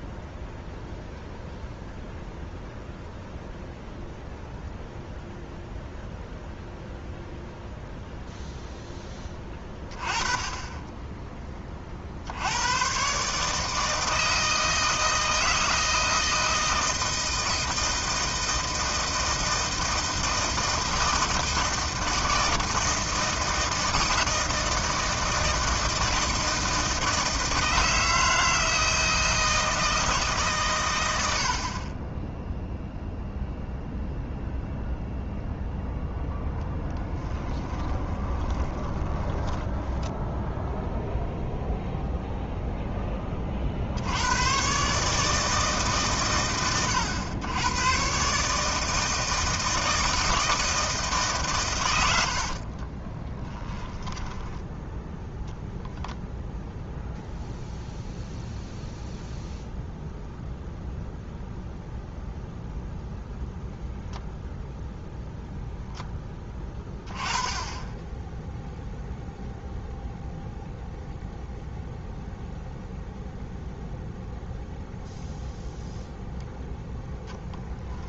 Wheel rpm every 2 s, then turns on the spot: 0, 0, 0, 0, 0, 10, 110, 160, 160, 160, 160, 160, 160, 160, 160, 130, 0, 0, 0, 20, 0, 0, 110, 90, 150, 160, 40, 10, 0, 0, 0, 0, 0, 20, 0, 0, 0, 0, 0.
38-40 52-54